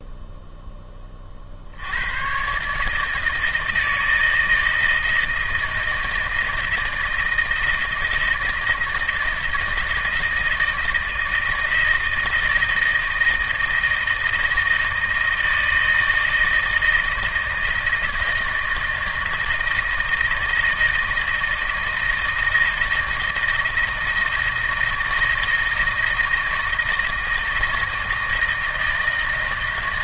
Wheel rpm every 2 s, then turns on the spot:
10, 140, 160, 160, 160, 160, 160, 160, 160, 160, 160, 160, 160, 160, 160.
none